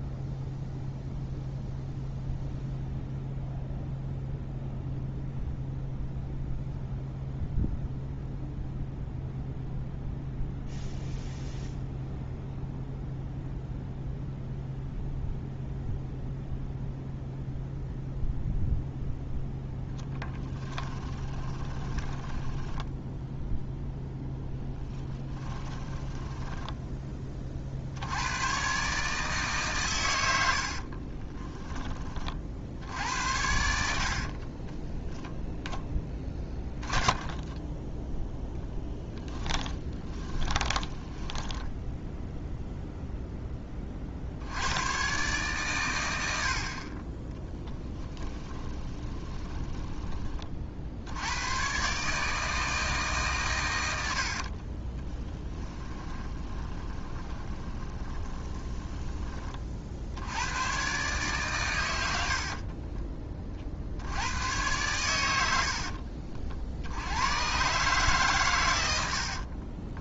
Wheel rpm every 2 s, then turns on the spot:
0, 0, 0, 0, 0, 0, 0, 0, 0, 0, 10, 10, 10, 10, 130, 50, 70, 10, 10, 10, 20, 0, 110, 40, 20, 60, 150, 30, 20, 20, 130, 40, 110, 80, 100.
20-28 30-32 34-38 40-42 48-50 54-58 62-64 68-70